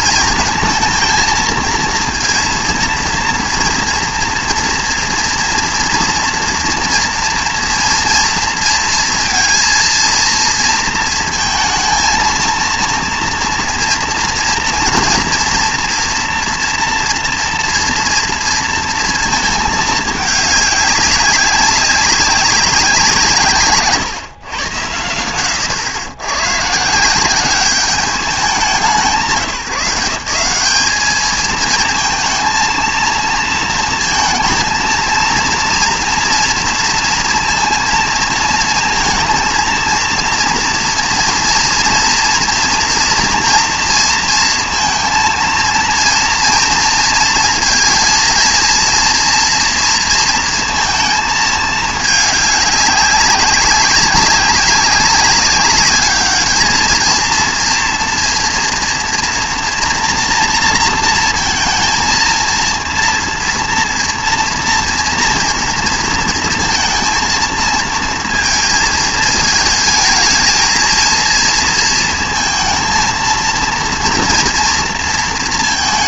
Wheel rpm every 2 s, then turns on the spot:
230, 230, 230, 230, 230, 230, 230, 230, 230, 230, 210, 190, 120, 130, 180, 190, 230, 230, 230, 230, 230, 230, 230, 230, 230, 230, 200, 200, 220, 230, 230, 230, 230, 230, 230, 220, 230, 230.
none